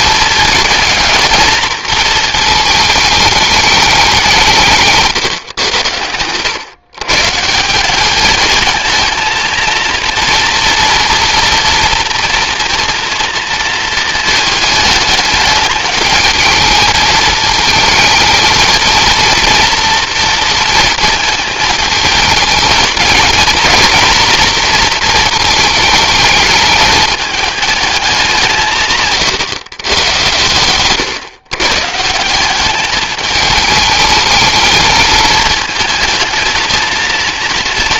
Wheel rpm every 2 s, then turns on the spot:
220, 220, 160, 130, 220, 230, 230, 220, 220, 230, 230, 220, 230, 210, 150, 130, 200, 220, 220.
none